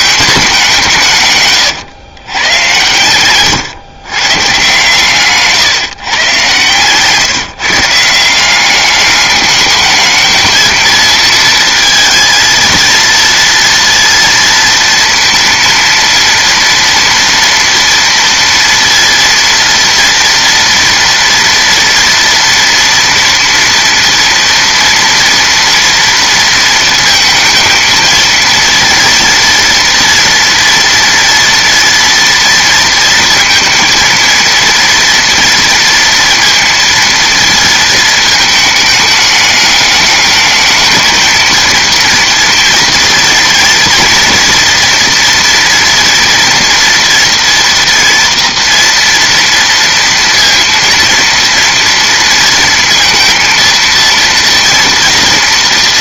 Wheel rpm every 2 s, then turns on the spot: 190, 120, 150, 130, 190, 220, 230, 230, 230, 230, 230, 230, 230, 230, 230, 230, 230, 230, 230, 220, 220, 240, 240, 240, 240, 230, 230, 230.
none